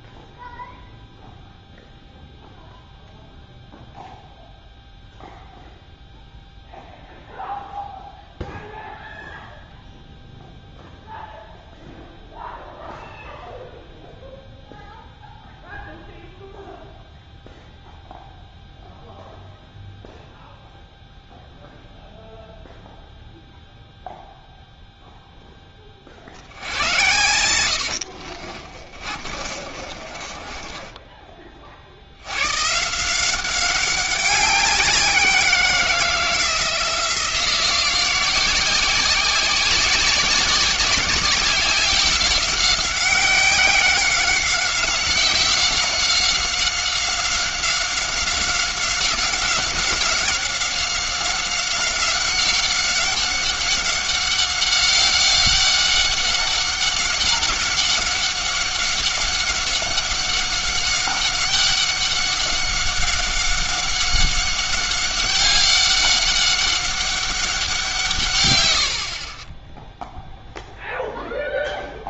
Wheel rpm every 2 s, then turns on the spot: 0, 0, 0, 0, 0, 0, 0, 0, 0, 0, 0, 0, 0, 80, 30, 20, 130, 180, 170, 180, 190, 190, 190, 190, 190, 190, 190, 190, 190, 190, 190, 190, 190, 190, 100, 0.
28-32